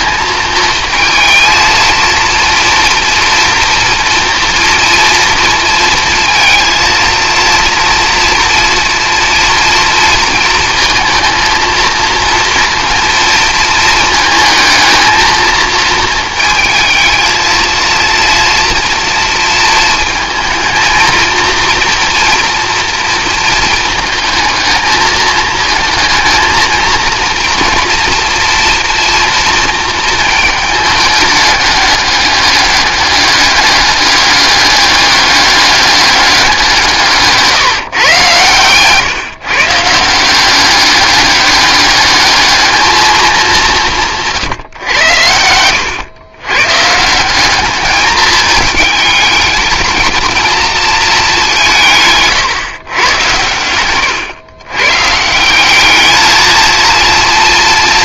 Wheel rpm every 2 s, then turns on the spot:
220, 230, 230, 230, 230, 220, 230, 220, 220, 230, 230, 230, 220, 230, 230, 220, 200, 200, 170, 130, 200, 210, 110, 150, 220, 220, 120, 130, 230.
none